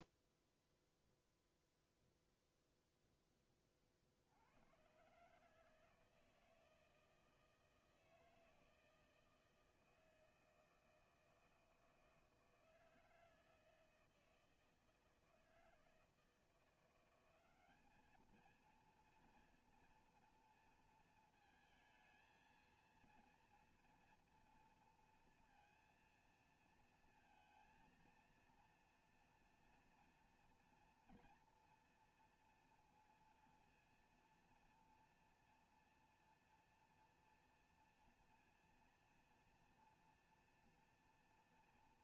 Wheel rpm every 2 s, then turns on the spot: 0, 0, 70, 160, 160, 160, 160, 160, 160, 220, 230, 220, 230, 230, 230, 230, 240, 230, 230, 230, 230.
none